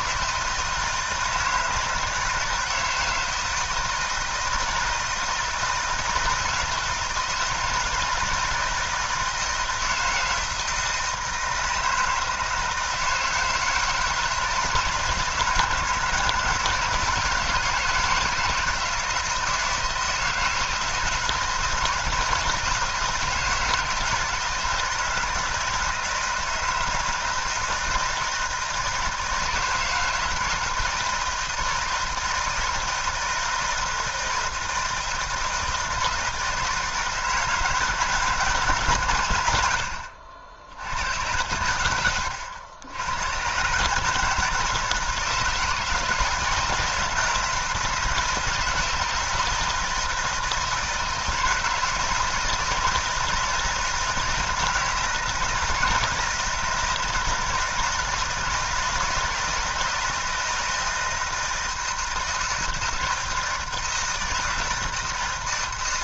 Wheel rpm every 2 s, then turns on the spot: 160, 160, 160, 160, 160, 160, 160, 160, 160, 160, 160, 160, 160, 160, 160, 160, 160, 170, 160, 150, 80, 90, 160, 160, 160, 160, 170, 160, 160, 160, 160, 160, 160.
none